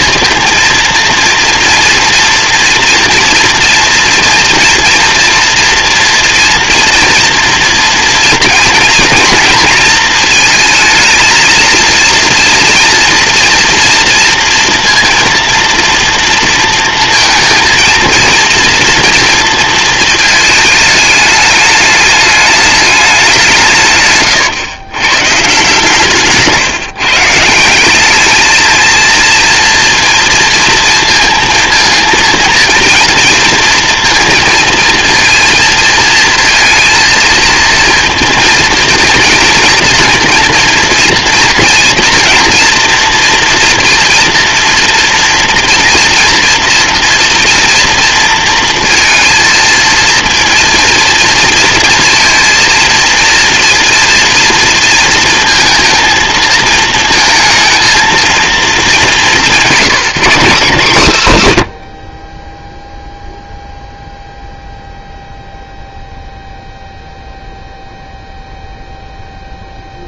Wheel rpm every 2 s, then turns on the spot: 230, 230, 230, 240, 240, 220, 230, 230, 230, 240, 210, 200, 130, 150, 230, 230, 230, 230, 230, 230, 230, 230, 230, 230, 230, 230, 230, 230, 230, 200, 150, 0, 0, 0, 0.
none